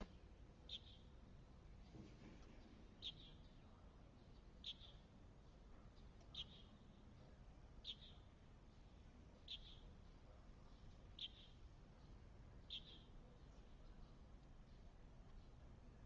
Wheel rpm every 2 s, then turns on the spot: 0, 0, 0, 0, 0, 0, 0, 0.
none